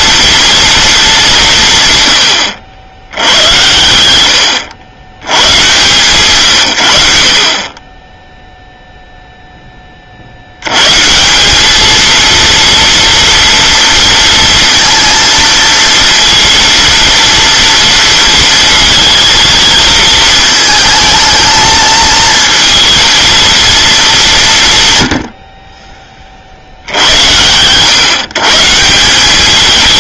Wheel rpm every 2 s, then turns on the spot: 230, 80, 100, 100, 0, 90, 230, 230, 230, 230, 220, 220, 160, 60, 150.
none